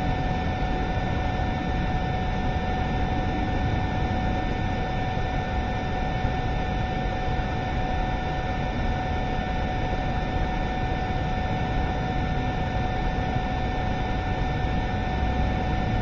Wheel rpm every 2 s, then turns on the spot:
0, 0, 0, 0, 0, 0, 0, 0.
none